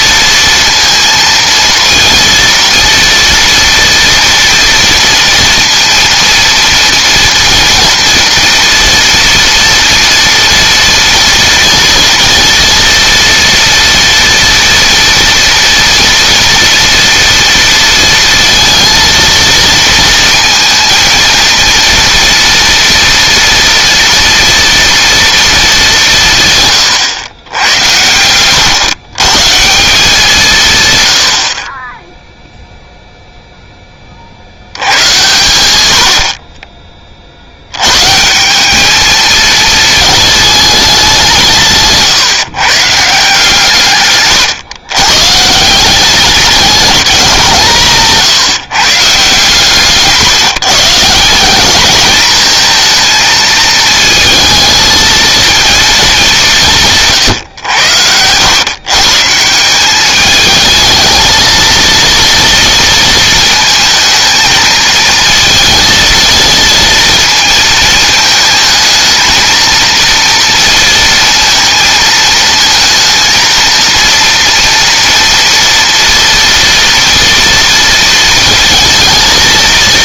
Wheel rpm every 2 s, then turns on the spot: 230, 230, 230, 230, 230, 230, 230, 230, 230, 230, 220, 230, 230, 140, 110, 140, 0, 80, 30, 190, 210, 150, 130, 200, 140, 140, 220, 220, 180, 120, 220, 230, 220, 230, 220, 230, 230, 230, 230, 230.
none